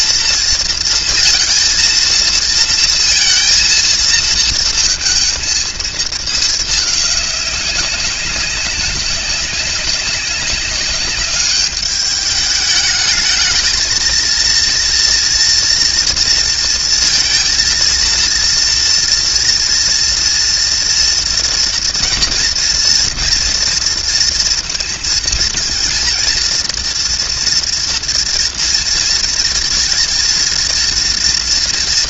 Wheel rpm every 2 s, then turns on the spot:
230, 230, 220, 220, 200, 200, 210, 230, 230, 230, 240, 230, 230, 230, 230, 220.
none